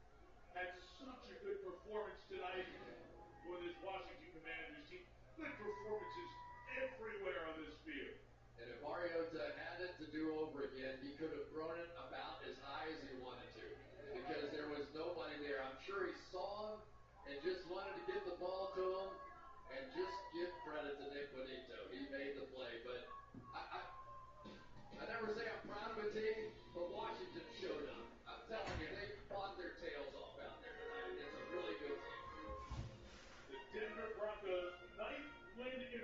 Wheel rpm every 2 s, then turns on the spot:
0, 0, 0, 0, 0, 0, 0, 0, 0, 0, 0, 0, 0, 0, 0, 0, 0, 0.
none